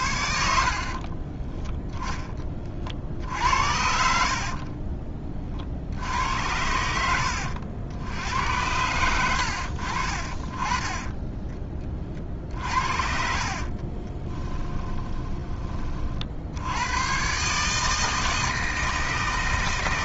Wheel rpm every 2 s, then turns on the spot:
50, 50, 40, 90, 100, 40, 50, 20, 100, 160.
0-2 6-8 12-16